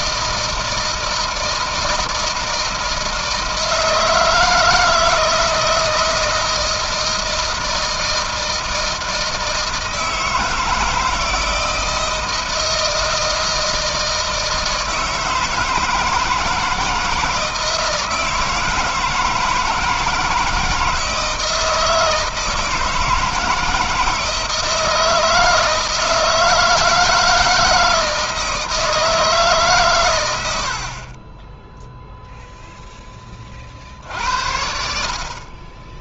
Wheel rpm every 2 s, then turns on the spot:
160, 160, 160, 160, 160, 160, 160, 160, 160, 160, 160, 160, 160, 160, 160, 40, 10, 60.
none